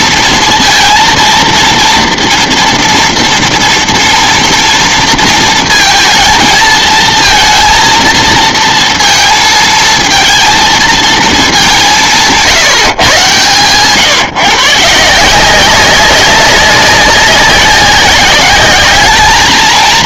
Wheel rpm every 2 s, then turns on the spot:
230, 230, 230, 220, 230, 220, 160, 150, 190, 200.
none